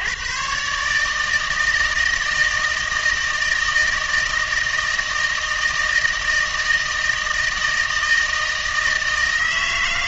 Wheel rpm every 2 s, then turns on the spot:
140, 160, 160, 160, 160.
none